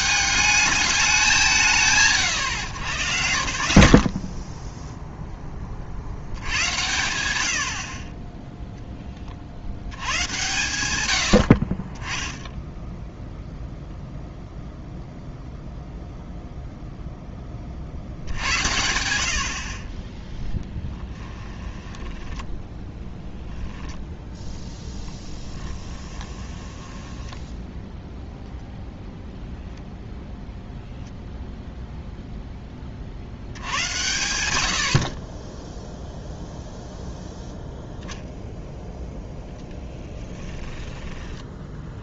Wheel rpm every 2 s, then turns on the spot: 210, 120, 0, 60, 0, 100, 0, 0, 0, 80, 10, 10, 10, 20, 0, 0, 20, 80, 0, 0, 10.
20-22 26-28 40-42